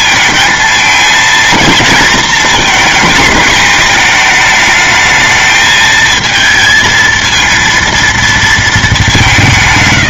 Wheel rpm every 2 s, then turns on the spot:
220, 230, 220, 230, 220.
none